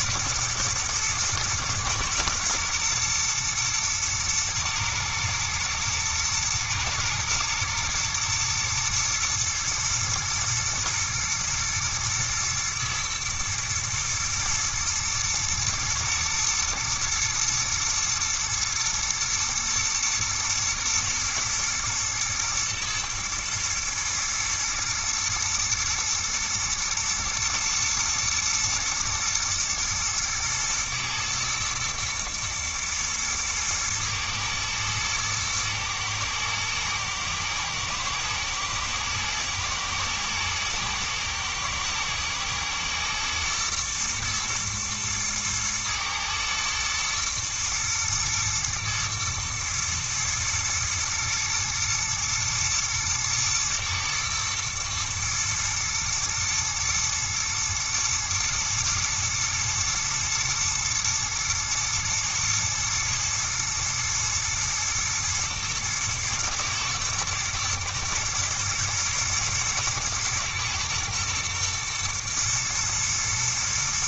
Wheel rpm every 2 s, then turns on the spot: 120, 110, 110, 110, 120, 110, 110, 110, 110, 110, 120, 120, 120, 120, 120, 110, 110, 110, 120, 110, 110, 110, 110, 110, 120, 120, 120, 120, 120, 120, 110, 110, 110, 110, 110, 110, 110.
none